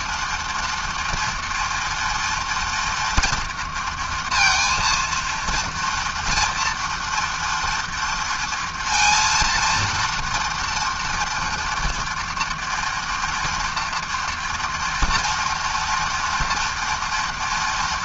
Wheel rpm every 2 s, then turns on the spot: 230, 230, 230, 230, 230, 230, 230, 240, 230.
none